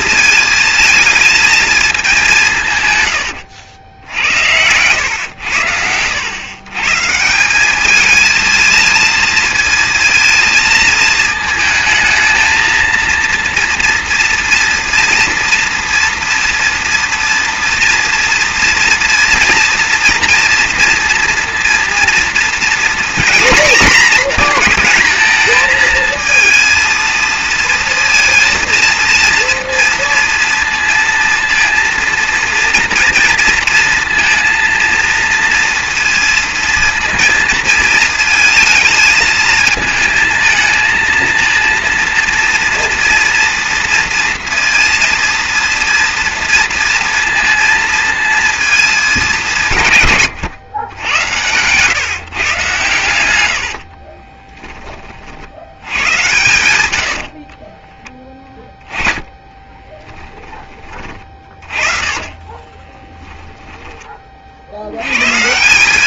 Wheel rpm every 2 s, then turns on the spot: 220, 150, 90, 120, 220, 230, 230, 230, 230, 230, 230, 230, 230, 230, 230, 230, 230, 230, 230, 220, 220, 230, 230, 230, 230, 130, 130, 20, 90, 10, 20, 30, 50.
50-52 54-60 62-64